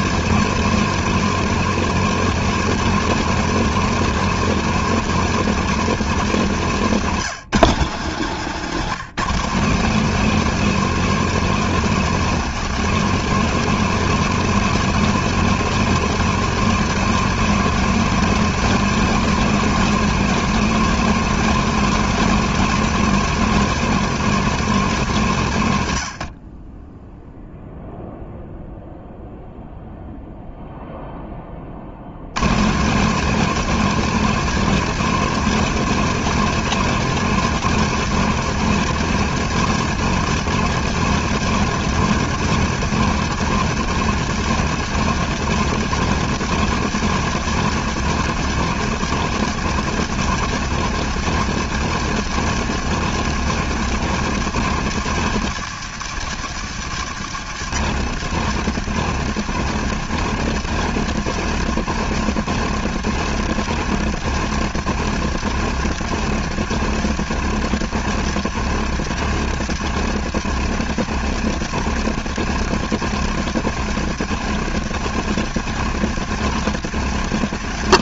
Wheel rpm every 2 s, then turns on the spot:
220, 220, 220, 170, 180, 220, 220, 230, 230, 220, 230, 220, 160, 0, 0, 10, 210, 210, 220, 210, 210, 210, 210, 210, 200, 200, 210, 190, 170, 170, 170, 170, 170, 170, 170, 170, 160, 170, 170.
none